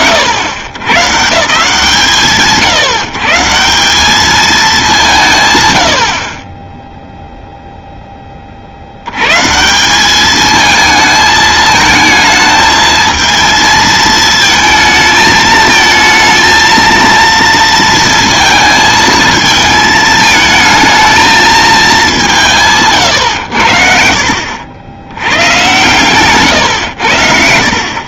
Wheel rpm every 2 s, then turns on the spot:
90, 140, 180, 0, 100, 220, 220, 220, 230, 220, 220, 110, 90, 90.
none